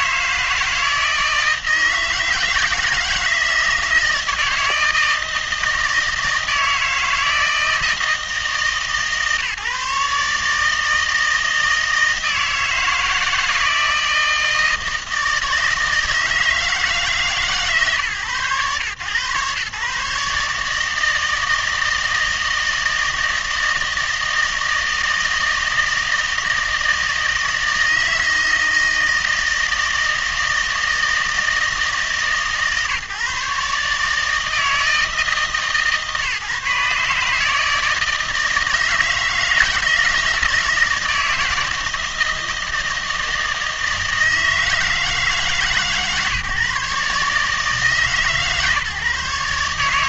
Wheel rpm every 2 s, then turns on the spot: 160, 160, 160, 160, 150, 150, 160, 160, 160, 120, 150, 160, 160, 160, 160, 160, 140, 160, 140, 160, 160, 160, 160, 140, 150.
none